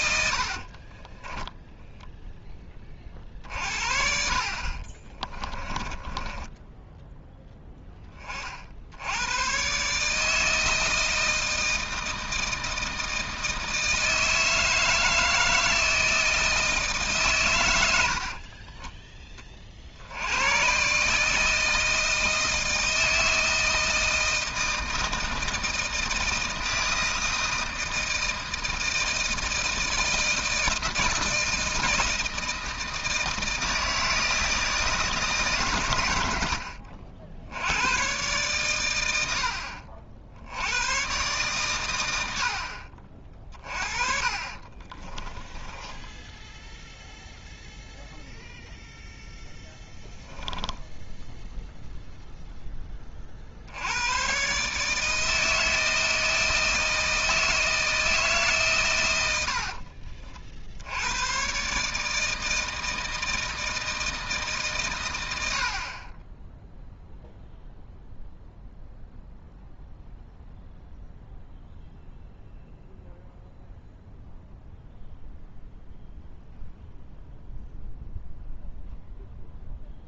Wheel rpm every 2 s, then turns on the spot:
60, 20, 50, 10, 60, 160, 160, 160, 160, 30, 120, 160, 160, 160, 160, 160, 160, 160, 70, 120, 90, 60, 30, 0, 0, 10, 10, 140, 160, 140, 70, 160, 140, 0, 0, 0, 0, 0, 0, 0.
0-2 4-8 18-20 44-46